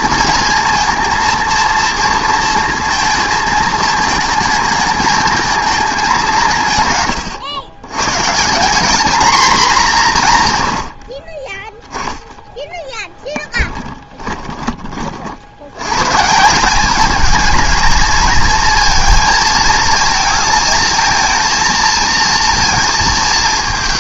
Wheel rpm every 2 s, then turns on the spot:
230, 230, 220, 150, 190, 120, 20, 20, 180, 220, 220, 230.
12-14